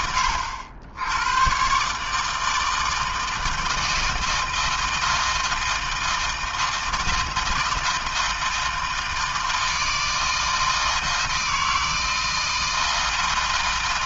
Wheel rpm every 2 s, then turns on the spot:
100, 160, 160, 160, 160, 160, 160.
none